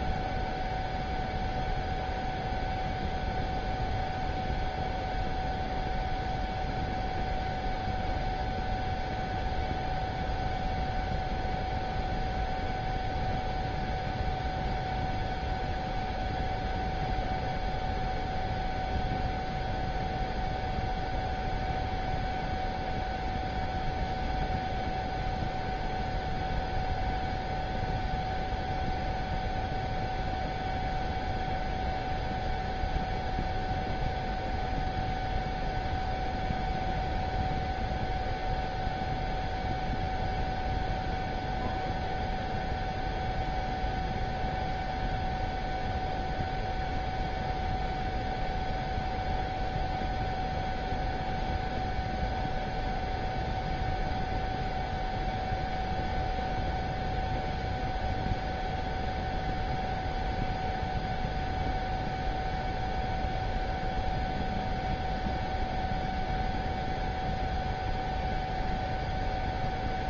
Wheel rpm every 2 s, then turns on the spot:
0, 0, 0, 0, 0, 0, 0, 0, 0, 0, 0, 0, 0, 0, 0, 0, 0, 0, 0, 0, 0, 0, 0, 0, 0, 0, 0, 0, 0, 0, 0, 0, 0, 0, 0.
none